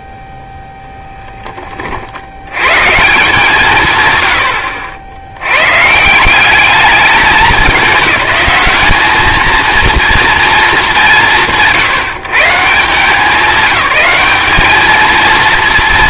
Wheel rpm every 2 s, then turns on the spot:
0, 160, 90, 200, 210, 170, 150, 210.
none